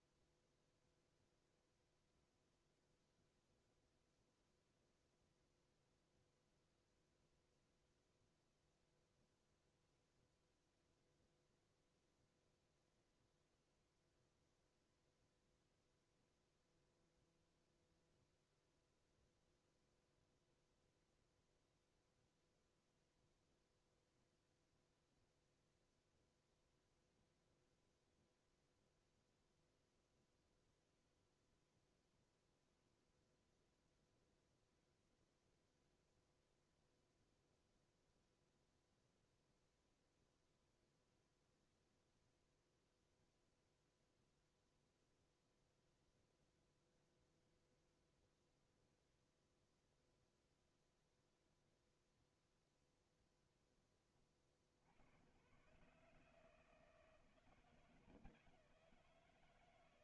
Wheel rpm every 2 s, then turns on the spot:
0, 0, 0, 0, 0, 0, 0, 0, 0, 0, 0, 0, 0, 0, 0, 0, 0, 0, 0, 0, 0, 0, 0, 0, 0, 0, 0, 60, 160, 180.
none